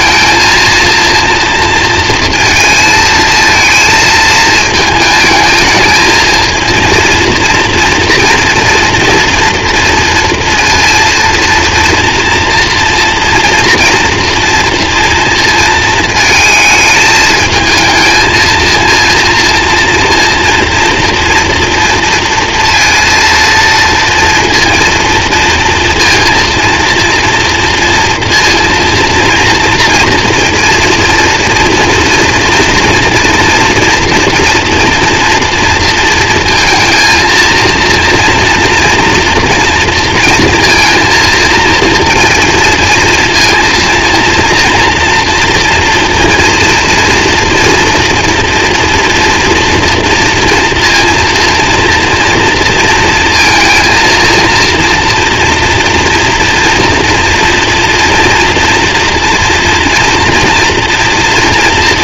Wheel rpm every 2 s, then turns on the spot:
230, 230, 220, 230, 230, 230, 240, 230, 220, 230, 230, 230, 230, 230, 230, 230, 240, 230, 230, 230, 230, 230, 230, 230, 230, 230, 230, 230, 230, 230, 240.
none